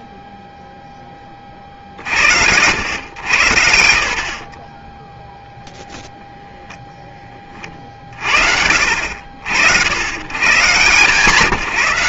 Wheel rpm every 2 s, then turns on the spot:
0, 90, 40, 0, 80, 90.
4-6